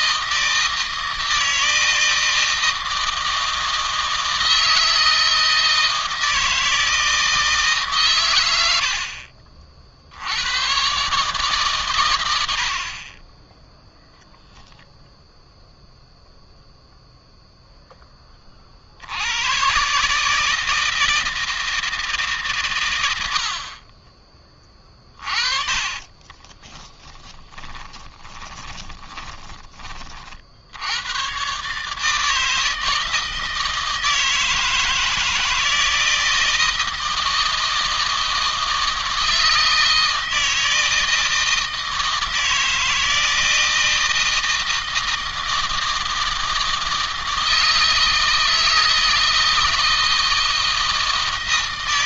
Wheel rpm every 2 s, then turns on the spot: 160, 160, 160, 160, 90, 110, 70, 0, 0, 40, 160, 130, 20, 30, 20, 70, 160, 160, 170, 160, 160, 160, 160, 160, 160, 160.
26-30